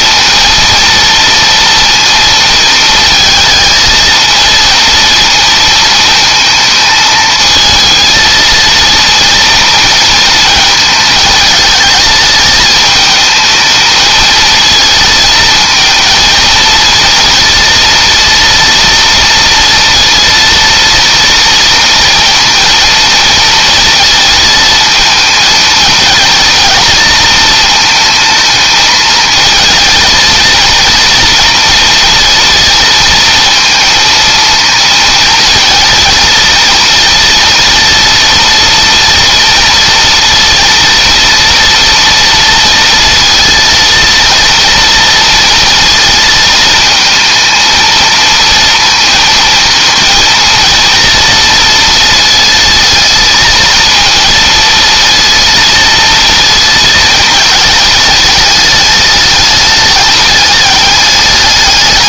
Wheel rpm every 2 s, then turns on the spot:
230, 220, 230, 220, 230, 220, 220, 220, 230, 230, 230, 230, 220, 230, 220, 230, 230, 230, 230, 230, 230, 230, 230, 220, 230, 230, 230, 230, 220, 210, 210.
none